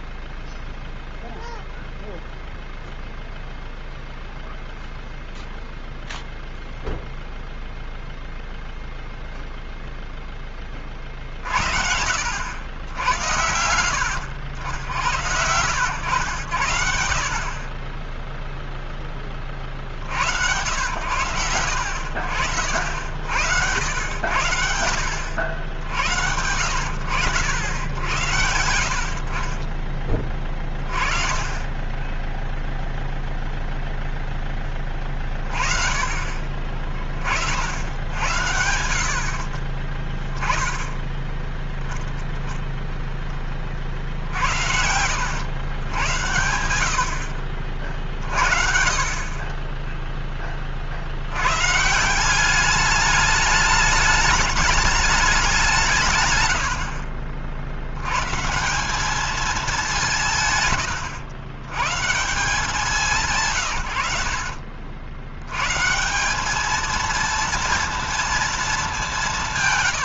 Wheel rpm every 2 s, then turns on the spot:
0, 0, 0, 0, 0, 20, 80, 90, 90, 0, 80, 70, 80, 80, 80, 20, 0, 10, 30, 80, 10, 0, 70, 80, 50, 30, 190, 210, 110, 160, 140, 170, 80, 210, 220.
44-46